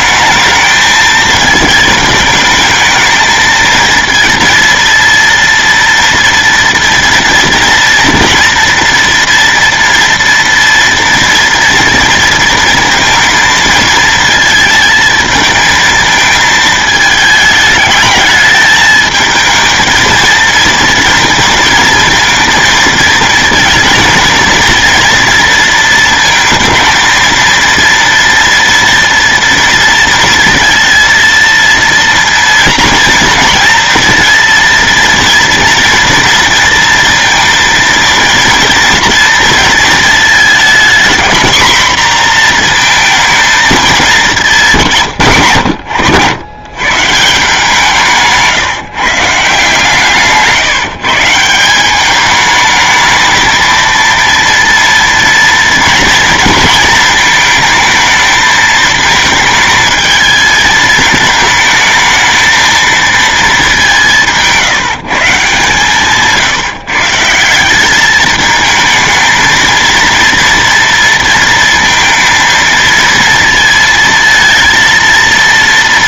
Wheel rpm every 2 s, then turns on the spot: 220, 220, 230, 230, 230, 230, 230, 220, 220, 220, 230, 220, 230, 220, 240, 230, 230, 230, 230, 230, 230, 230, 180, 120, 150, 140, 220, 230, 230, 220, 220, 230, 160, 150, 220, 230, 220, 230.
none